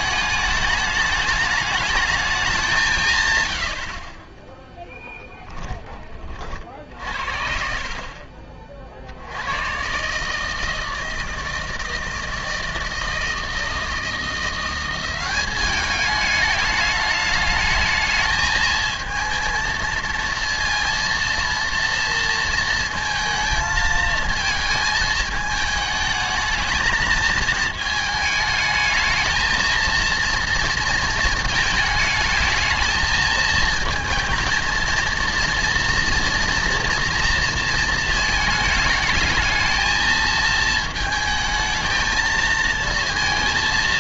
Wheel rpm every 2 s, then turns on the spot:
220, 190, 10, 40, 40, 160, 160, 170, 210, 220, 230, 230, 220, 220, 220, 230, 220, 230, 230, 220, 220, 220.
none